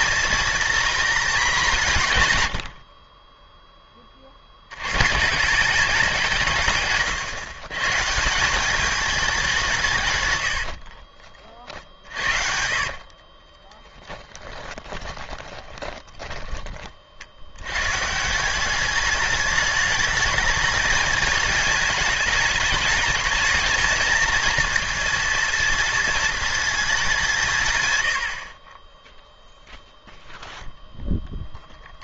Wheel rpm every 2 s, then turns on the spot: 230, 90, 100, 140, 200, 80, 60, 20, 30, 180, 210, 210, 230, 220, 50, 0.
10-16